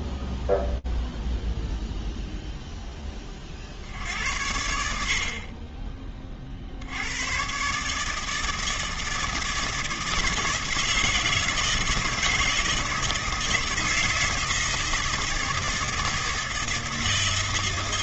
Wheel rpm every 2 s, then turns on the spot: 0, 10, 70, 90, 170, 160, 160, 160, 160.
none